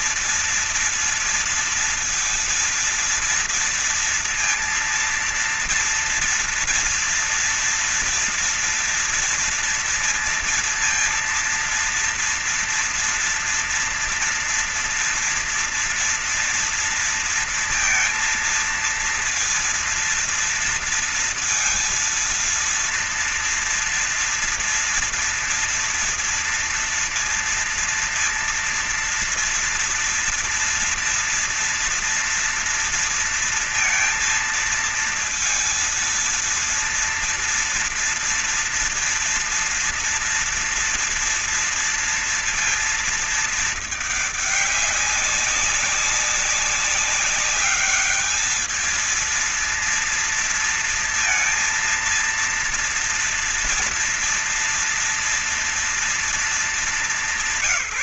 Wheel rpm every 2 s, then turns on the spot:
230, 230, 230, 240, 230, 230, 230, 230, 230, 230, 230, 230, 230, 230, 230, 230, 230, 230, 230, 230, 240, 230, 210, 200, 220, 230, 230, 230, 230.
none